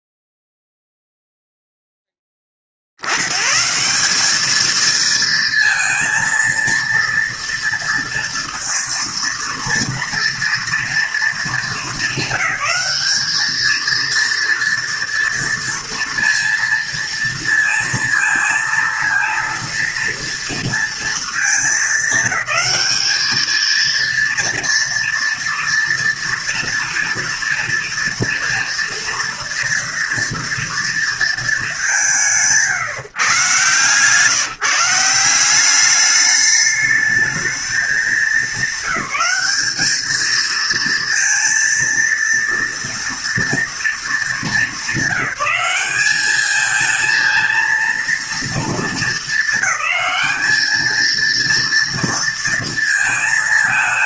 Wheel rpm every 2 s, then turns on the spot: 0, 40, 210, 230, 230, 230, 200, 230, 230, 230, 230, 210, 230, 230, 230, 230, 160, 160, 210, 210, 230, 230, 200, 220, 230, 220, 230.
none